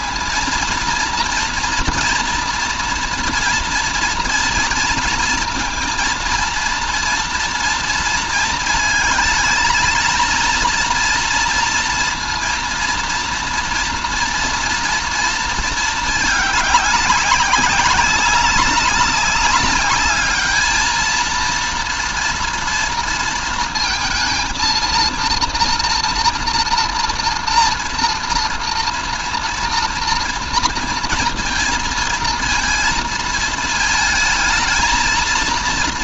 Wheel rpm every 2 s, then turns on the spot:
230, 230, 230, 240, 220, 230, 230, 230, 200, 200, 230, 230, 230, 230, 230, 230, 220, 220.
none